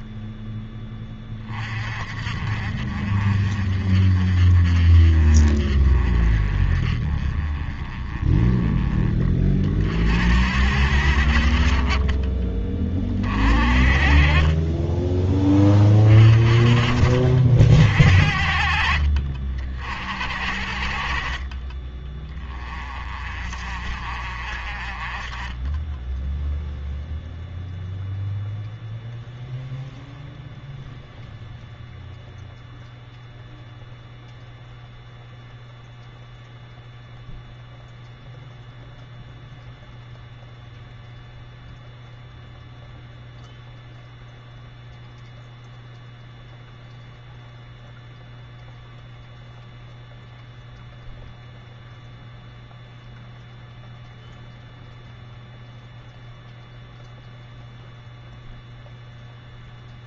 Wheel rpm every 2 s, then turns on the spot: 10, 50, 40, 30, 20, 80, 30, 20, 40, 50, 50, 30, 40, 0, 0, 0, 0, 0, 0, 0, 0, 0, 0, 0, 0, 0, 0, 0, 0, 0.
14-16